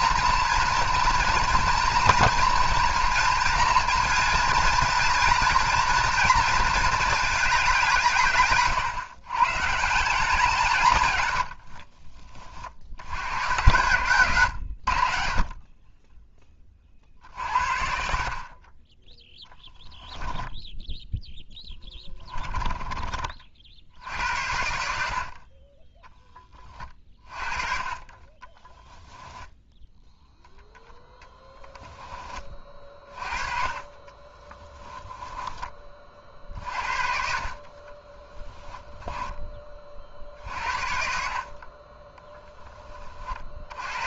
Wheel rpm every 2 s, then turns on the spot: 230, 240, 230, 220, 140, 160, 60, 100, 30, 20, 0, 20, 70, 30, 10, 0, 30, 10, 50, 10, 50, 20.
28-30 34-36 38-40